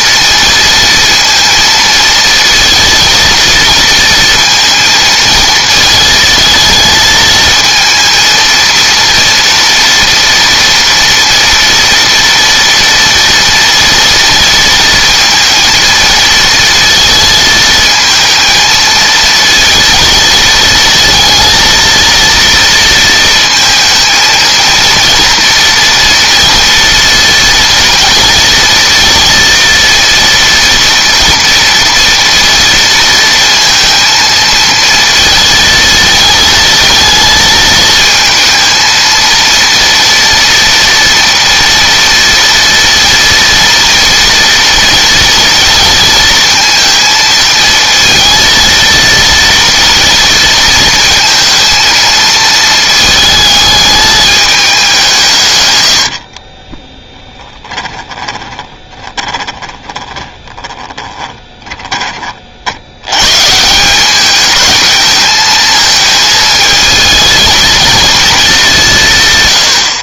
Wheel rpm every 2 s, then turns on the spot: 230, 230, 230, 220, 230, 240, 230, 230, 230, 220, 230, 230, 230, 230, 230, 230, 230, 230, 220, 220, 230, 230, 240, 220, 230, 230, 220, 200, 40, 20, 20, 70, 210, 220, 190.
56-62